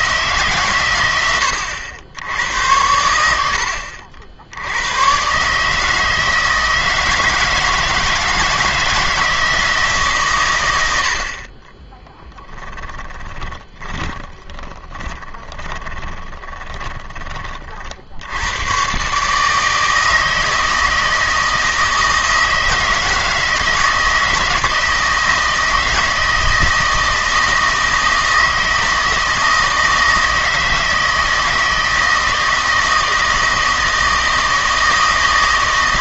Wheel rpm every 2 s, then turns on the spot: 120, 90, 90, 160, 160, 90, 10, 30, 20, 120, 160, 160, 160, 160, 160, 160, 160, 160.
12-18